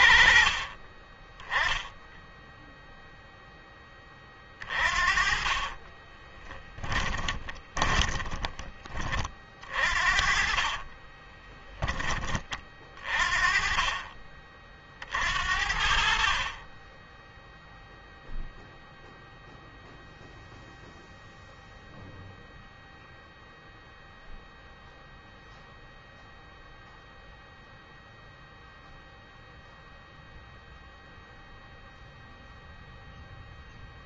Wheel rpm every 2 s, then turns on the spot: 20, 0, 40, 20, 30, 30, 30, 40, 20, 0, 0, 0, 0, 0, 0, 0, 0.
4-8 10-12